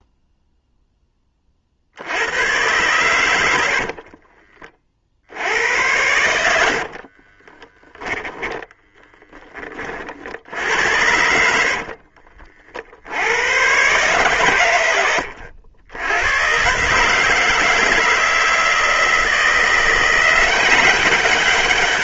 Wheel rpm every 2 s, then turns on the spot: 0, 90, 30, 80, 10, 60, 50, 120, 110, 160, 180.
4-8